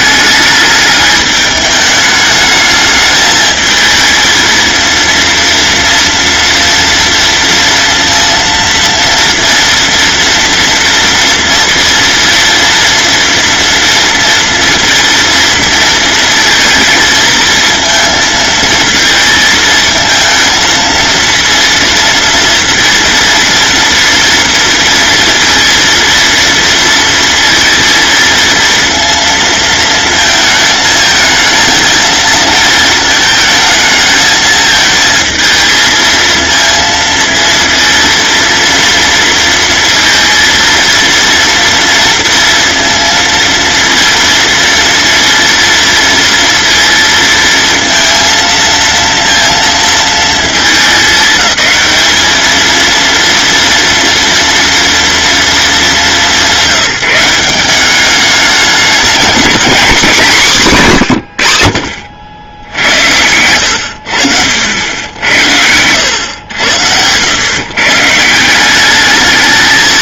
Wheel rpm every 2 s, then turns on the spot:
210, 210, 230, 230, 230, 230, 230, 230, 220, 220, 230, 230, 230, 230, 230, 220, 220, 220, 230, 230, 230, 230, 230, 230, 230, 210, 230, 230, 180, 210, 160, 80, 80, 100, 210.
62-64